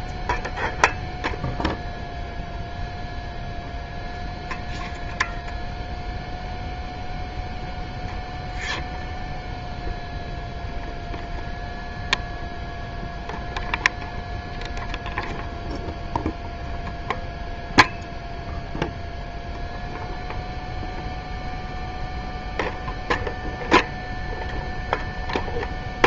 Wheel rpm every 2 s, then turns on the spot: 0, 0, 0, 0, 0, 0, 0, 0, 0, 0, 0, 0, 0.
none